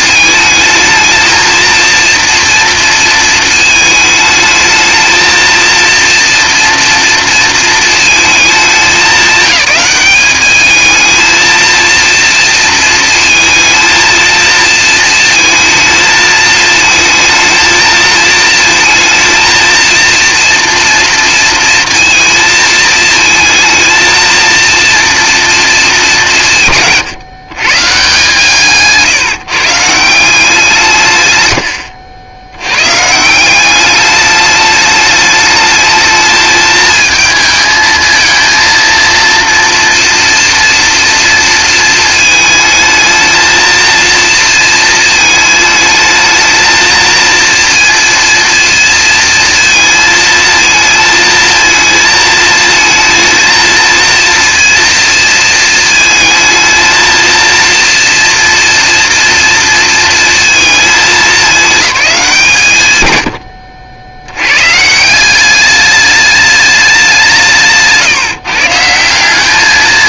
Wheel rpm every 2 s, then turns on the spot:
220, 230, 220, 230, 200, 210, 230, 230, 220, 230, 240, 220, 230, 140, 160, 150, 120, 210, 220, 230, 230, 220, 230, 230, 230, 220, 220, 230, 230, 240, 210, 130, 140, 200, 160.
28-30